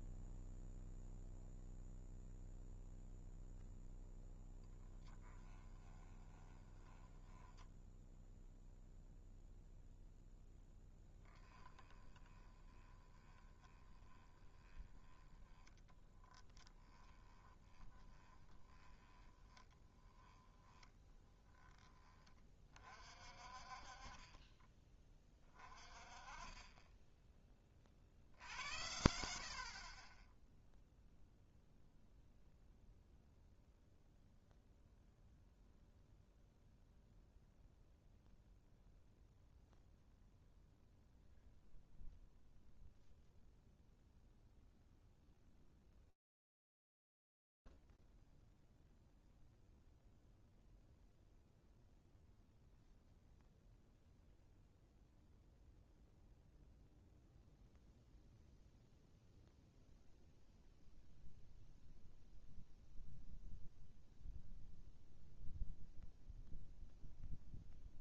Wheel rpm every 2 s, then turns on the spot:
0, 0, 10, 20, 0, 0, 20, 20, 10, 20, 20, 30, 20, 20, 80, 0, 0, 0, 0, 0, 0, 0, 0, 0, 0, 0, 0, 0, 0, 0, 0, 0, 0, 0.
4-8 12-22